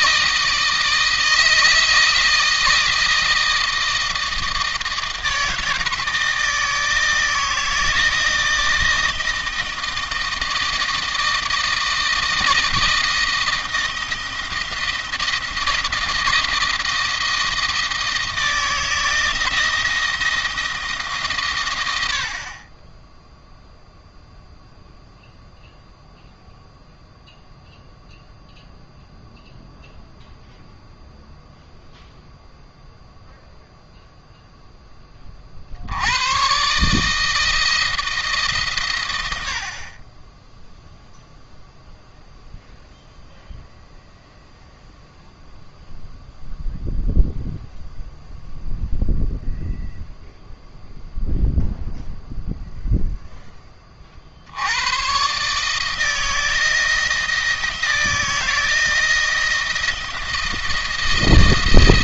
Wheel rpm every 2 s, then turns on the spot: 160, 160, 160, 160, 160, 160, 160, 170, 160, 160, 160, 40, 0, 0, 0, 0, 0, 10, 120, 140, 10, 0, 0, 0, 0, 0, 0, 80, 160, 160, 170.
none